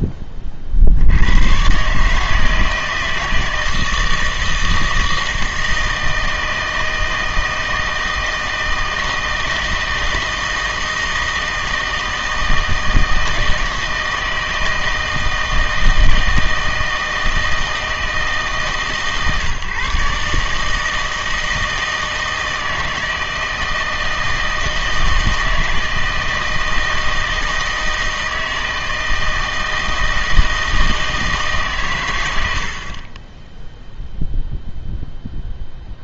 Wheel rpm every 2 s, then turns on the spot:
50, 160, 160, 160, 160, 160, 160, 160, 160, 140, 160, 160, 160, 160, 160, 160, 60, 0.
none